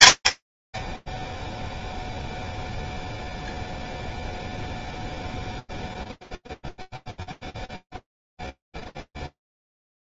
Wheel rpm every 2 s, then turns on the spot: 40, 0, 0, 0, 0.
none